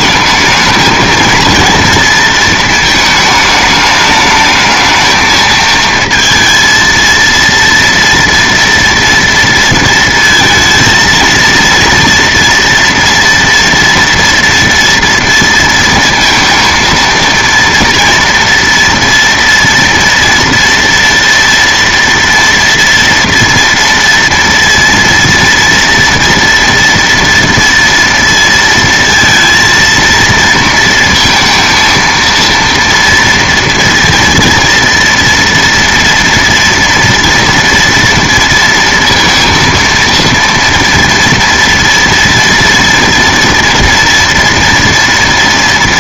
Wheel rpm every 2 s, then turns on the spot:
220, 220, 220, 230, 230, 230, 230, 240, 230, 230, 230, 230, 230, 230, 230, 230, 230, 230, 240, 230, 230, 230, 230.
none